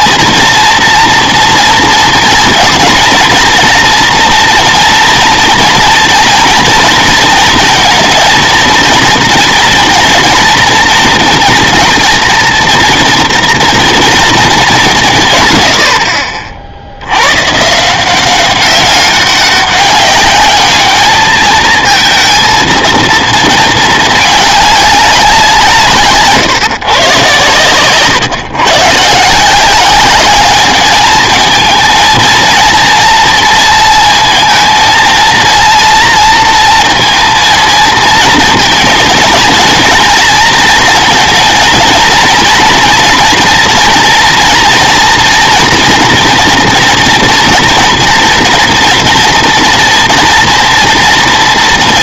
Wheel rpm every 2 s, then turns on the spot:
230, 230, 240, 230, 230, 240, 230, 200, 50, 190, 210, 230, 210, 140, 130, 200, 230, 230, 230, 220, 230, 230, 230, 230, 230, 230.
none